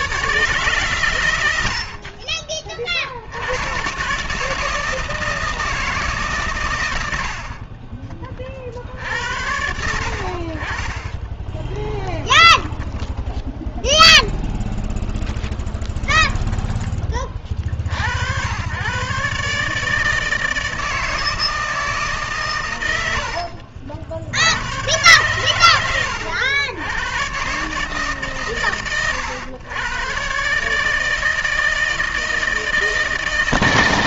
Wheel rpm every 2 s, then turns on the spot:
130, 30, 150, 120, 50, 50, 10, 0, 10, 90, 160, 120, 100, 100, 130, 140, 160.
12-14 16-18